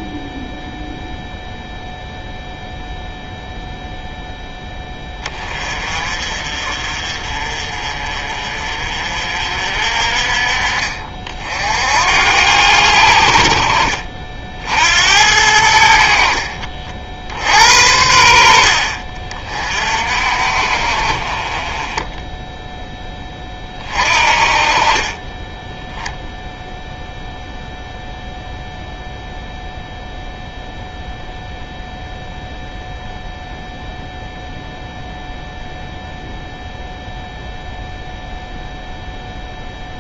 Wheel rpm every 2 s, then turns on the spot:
0, 0, 10, 40, 40, 40, 80, 70, 50, 50, 40, 10, 30, 0, 0, 0, 0, 0, 0, 0.
none